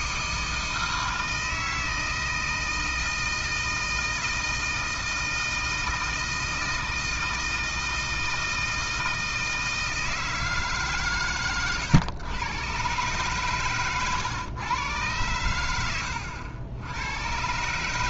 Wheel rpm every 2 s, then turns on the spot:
160, 160, 160, 160, 160, 160, 110, 110, 90.
none